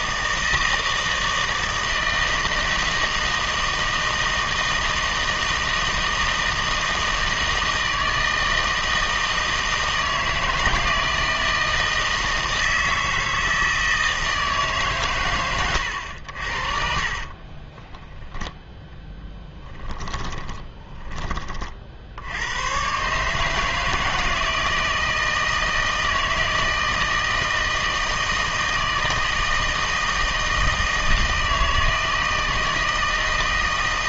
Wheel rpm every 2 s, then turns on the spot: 160, 160, 160, 160, 160, 160, 160, 150, 50, 20, 20, 110, 160, 160, 160, 160, 160.
16-22